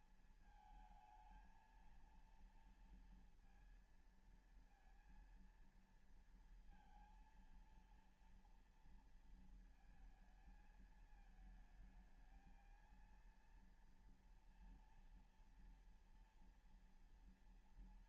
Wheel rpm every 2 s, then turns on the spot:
220, 230, 230, 230, 230, 220, 230, 230, 230.
none